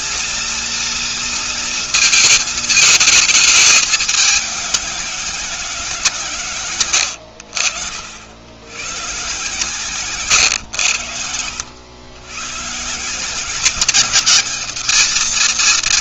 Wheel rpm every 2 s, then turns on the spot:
230, 220, 200, 140, 90, 130, 120, 210.
none